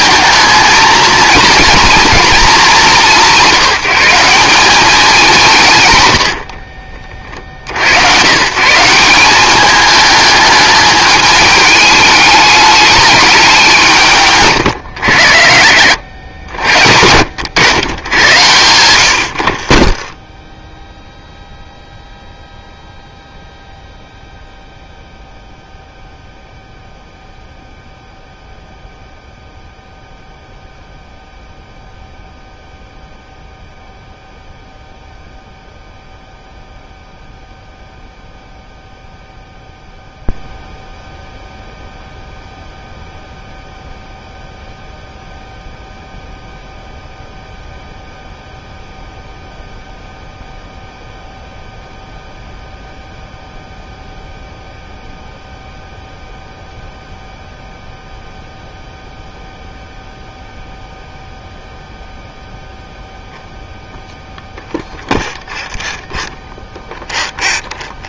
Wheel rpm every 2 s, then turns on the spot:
220, 210, 190, 50, 140, 210, 210, 130, 90, 100, 10, 0, 0, 0, 0, 0, 0, 0, 0, 0, 0, 0, 0, 0, 0, 0, 0, 0, 0, 0, 0, 0, 0, 0.
6-8 20-22